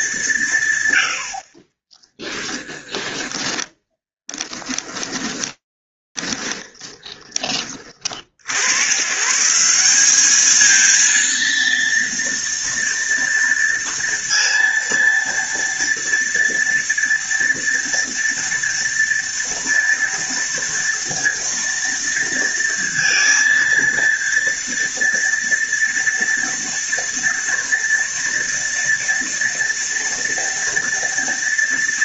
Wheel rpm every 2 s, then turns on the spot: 120, 10, 10, 20, 150, 230, 230, 230, 230, 230, 230, 230, 230, 230, 230, 230.
2-8